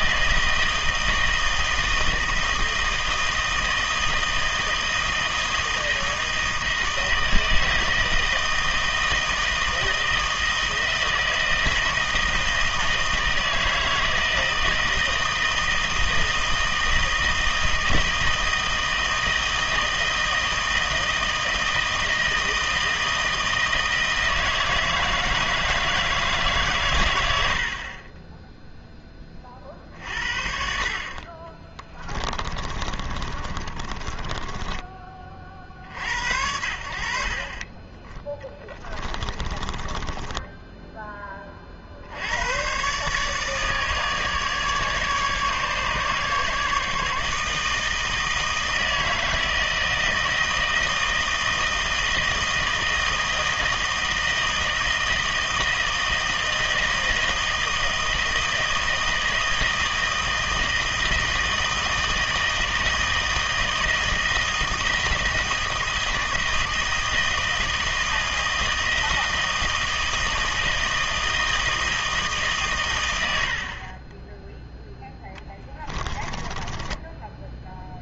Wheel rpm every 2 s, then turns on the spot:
160, 160, 160, 160, 160, 160, 160, 160, 160, 160, 160, 160, 160, 130, 0, 40, 30, 20, 70, 30, 10, 130, 150, 150, 160, 160, 160, 160, 160, 160, 160, 160, 160, 160, 160, 160, 130, 10, 20.
32-34 38-42 76-78